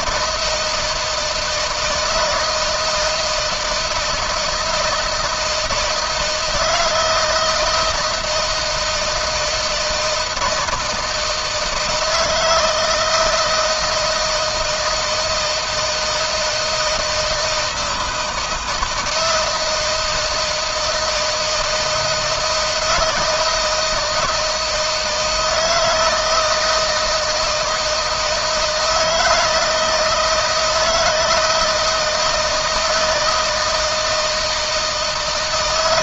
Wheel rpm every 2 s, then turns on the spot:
160, 160, 160, 160, 160, 160, 160, 160, 160, 170, 160, 160, 160, 160, 160, 160, 160, 160.
none